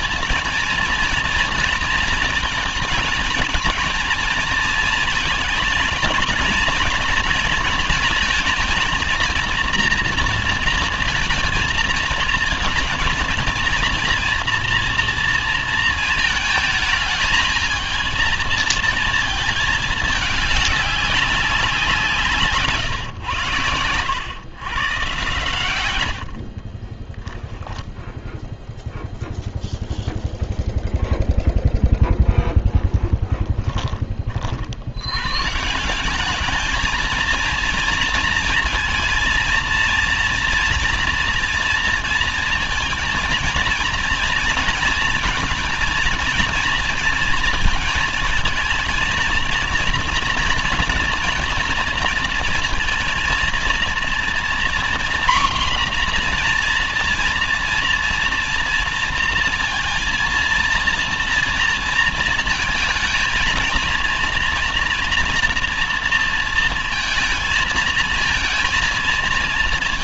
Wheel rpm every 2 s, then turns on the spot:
230, 220, 230, 230, 220, 230, 230, 240, 220, 230, 210, 150, 110, 60, 0, 0, 0, 50, 210, 230, 230, 230, 230, 230, 230, 230, 230, 240, 240, 230, 230, 220, 230, 230, 220.
26-28